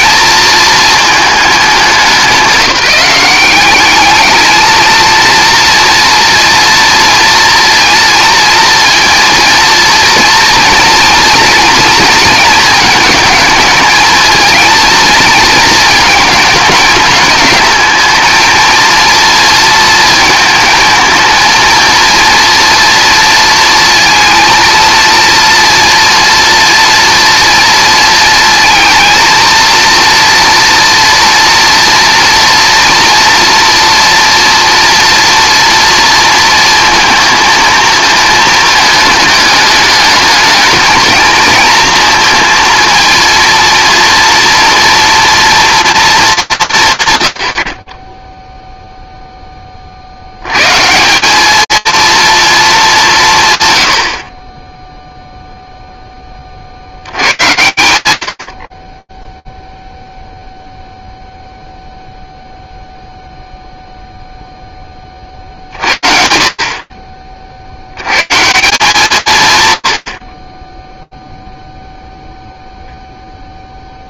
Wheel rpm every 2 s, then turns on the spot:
230, 190, 220, 230, 230, 230, 220, 220, 220, 230, 220, 230, 230, 230, 230, 240, 230, 230, 230, 220, 220, 230, 230, 160, 0, 140, 210, 10, 80, 10, 0, 0, 40, 60, 120, 0, 40.
none